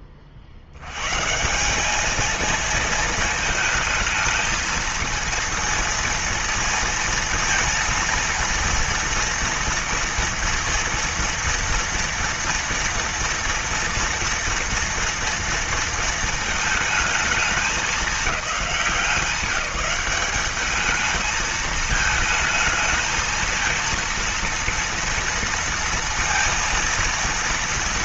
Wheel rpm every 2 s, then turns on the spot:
100, 220, 230, 230, 230, 230, 230, 230, 220, 200, 210, 220, 230, 230.
none